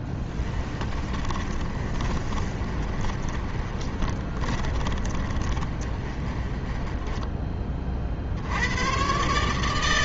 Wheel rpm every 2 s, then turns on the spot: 30, 30, 20, 10, 110.
0-6